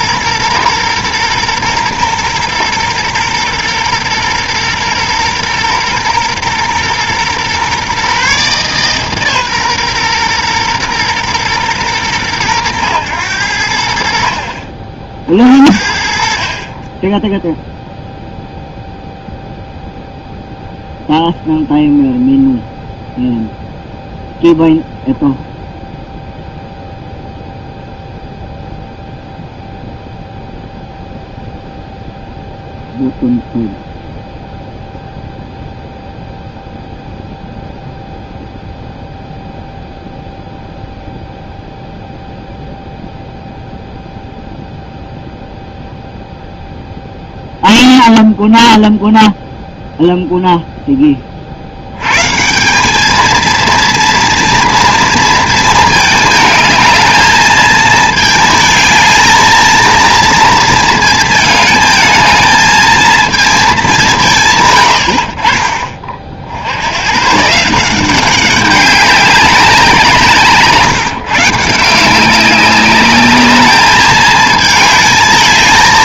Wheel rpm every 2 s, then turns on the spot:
120, 120, 120, 120, 140, 120, 100, 50, 30, 0, 0, 0, 0, 0, 0, 0, 0, 0, 0, 0, 0, 0, 0, 0, 0, 0, 180, 230, 220, 220, 230, 220, 120, 80, 190, 150, 200, 220.
none